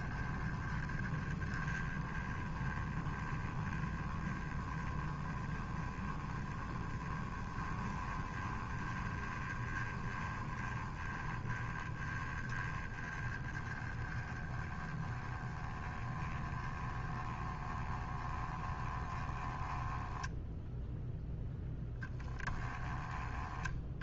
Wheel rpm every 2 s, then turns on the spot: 20, 20, 10, 20, 20, 20, 20, 10, 20, 10, 0, 10.
none